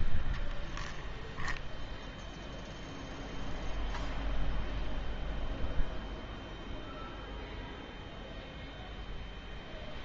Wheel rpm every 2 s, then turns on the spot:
0, 0, 0, 0, 0.
none